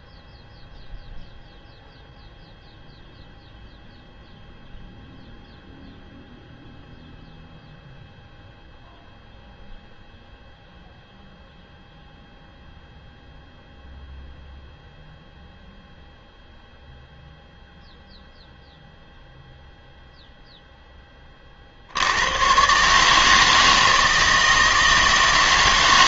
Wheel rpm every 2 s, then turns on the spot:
0, 0, 0, 0, 0, 0, 0, 0, 0, 0, 10, 140, 160.
none